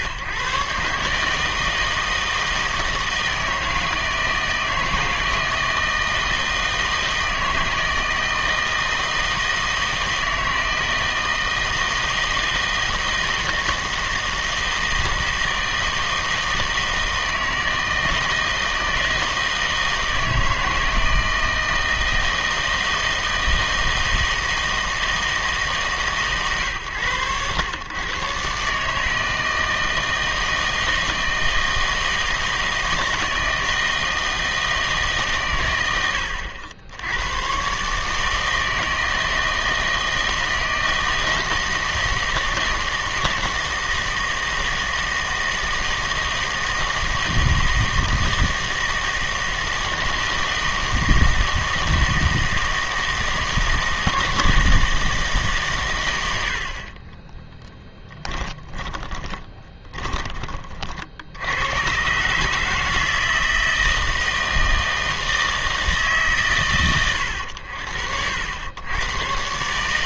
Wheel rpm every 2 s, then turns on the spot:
130, 160, 160, 160, 160, 160, 160, 160, 160, 160, 160, 160, 160, 120, 130, 160, 160, 160, 90, 160, 160, 160, 160, 160, 160, 160, 160, 160, 80, 10, 30, 150, 160, 130, 90.
58-60